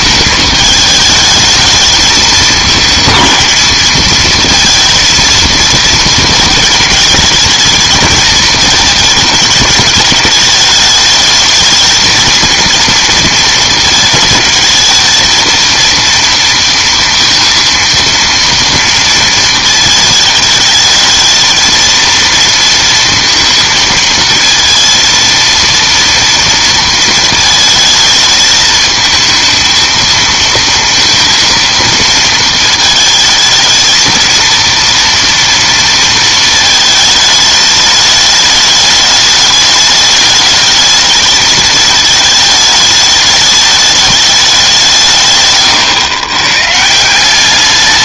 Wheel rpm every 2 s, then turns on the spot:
220, 210, 220, 220, 220, 210, 230, 220, 230, 230, 210, 230, 230, 230, 220, 230, 220, 230, 220, 210, 210, 220, 190, 140.
none